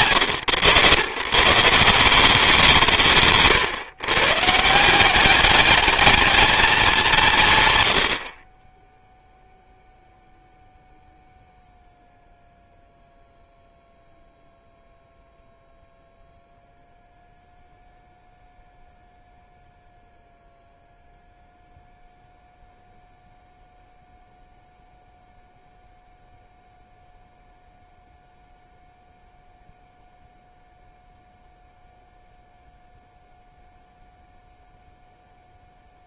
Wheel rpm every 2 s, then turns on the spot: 110, 170, 160, 210, 20, 0, 0, 0, 0, 0, 0, 0, 0, 0, 0, 0, 0, 0.
none